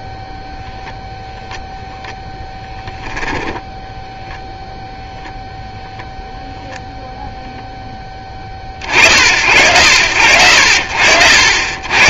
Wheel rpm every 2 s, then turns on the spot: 0, 0, 0, 0, 30, 60.
none